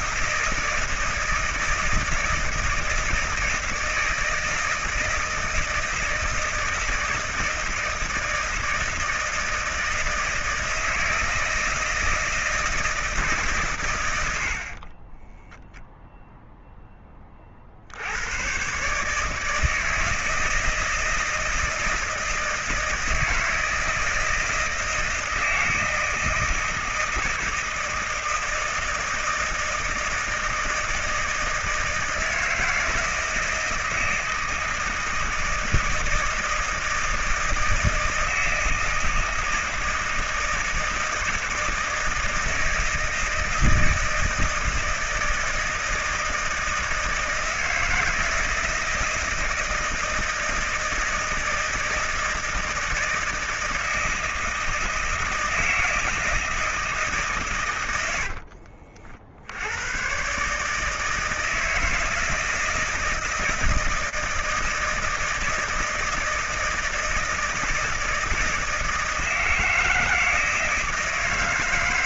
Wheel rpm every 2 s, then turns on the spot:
160, 160, 160, 160, 160, 160, 160, 30, 10, 140, 160, 160, 160, 160, 160, 160, 160, 160, 160, 160, 160, 160, 160, 160, 160, 160, 160, 160, 150, 50, 150, 160, 160, 160, 160, 160.
14-16